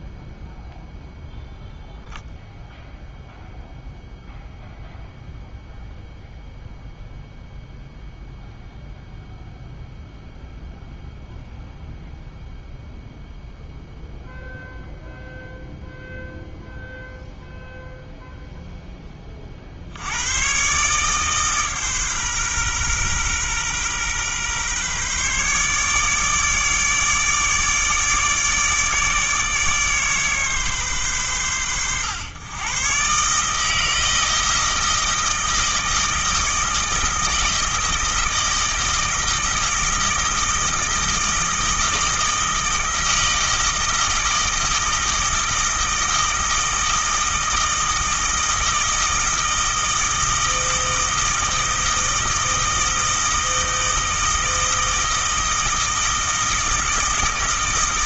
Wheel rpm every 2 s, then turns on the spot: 0, 0, 0, 0, 0, 0, 0, 0, 0, 20, 140, 120, 140, 150, 150, 120, 140, 160, 160, 160, 160, 160, 160, 160, 160, 160, 160, 160, 160.
none